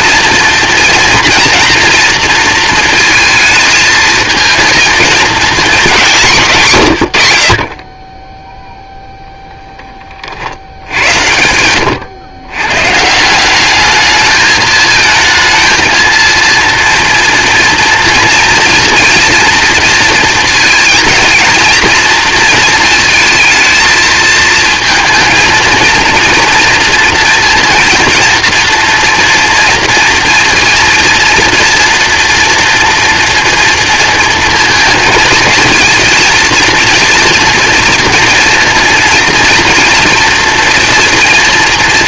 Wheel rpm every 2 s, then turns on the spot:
230, 230, 220, 100, 0, 90, 150, 220, 230, 230, 230, 220, 230, 230, 230, 230, 230, 230, 230, 230, 240.
none